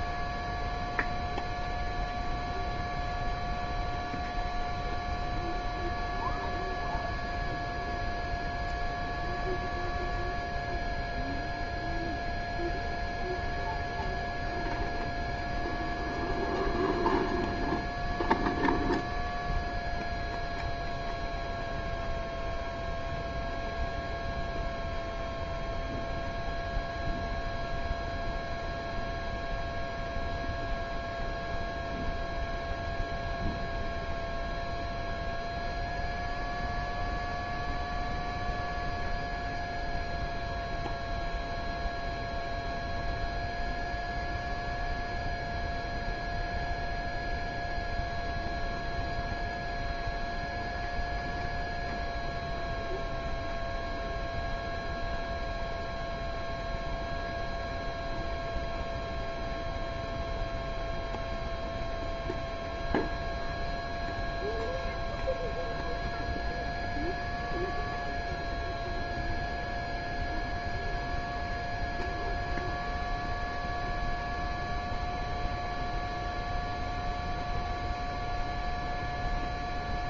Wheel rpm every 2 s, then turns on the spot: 0, 0, 0, 0, 0, 0, 0, 0, 0, 0, 0, 0, 0, 0, 0, 0, 0, 0, 0, 0, 0, 0, 0, 0, 0, 0, 0, 0, 0, 0, 0, 0, 0, 0, 0, 0, 0, 0, 0, 0.
none